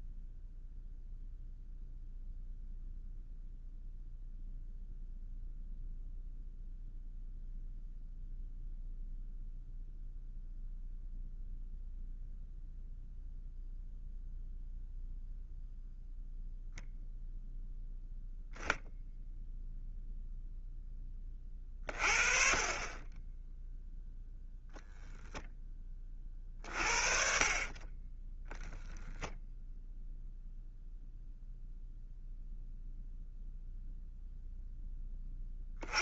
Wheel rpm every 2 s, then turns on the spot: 0, 0, 0, 0, 0, 0, 0, 0, 0, 0, 10, 30, 0, 50, 0, 0, 0, 10.
none